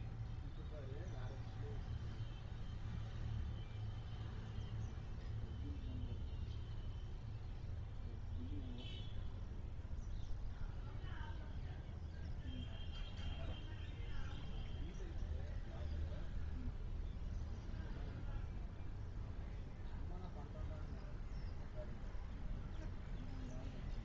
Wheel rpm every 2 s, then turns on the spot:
0, 0, 0, 0, 0, 0, 0, 0, 0, 0, 0, 0.
none